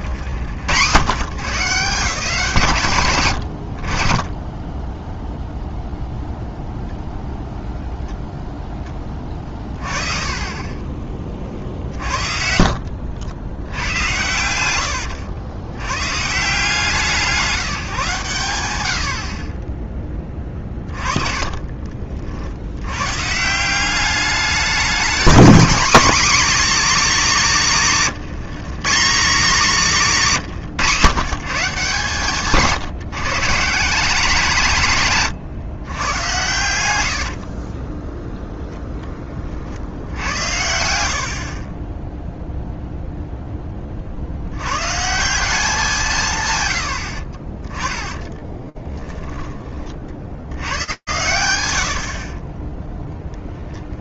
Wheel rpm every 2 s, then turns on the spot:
140, 140, 10, 0, 20, 20, 50, 90, 170, 70, 30, 90, 210, 260, 170, 150, 140, 170, 100, 0, 80, 0, 110, 130, 10, 110, 0.
12-14 20-22 48-50